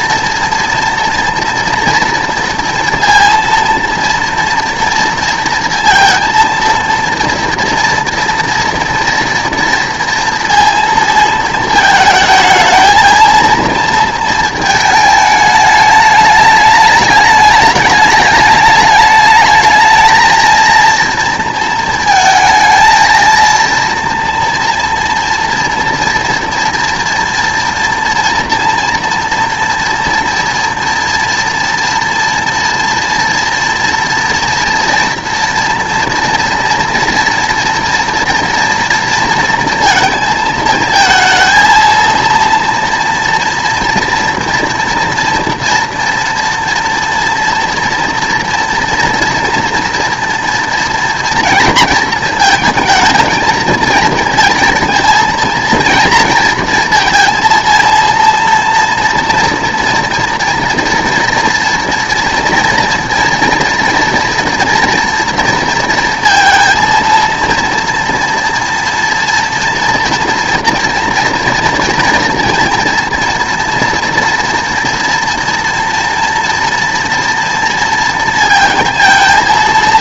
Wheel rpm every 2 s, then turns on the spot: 230, 230, 230, 230, 230, 230, 220, 220, 210, 210, 230, 220, 230, 230, 230, 230, 230, 230, 230, 230, 220, 230, 240, 230, 240, 230, 220, 230, 230, 230, 230, 230, 230, 230, 230, 230, 230, 230, 230, 230.
none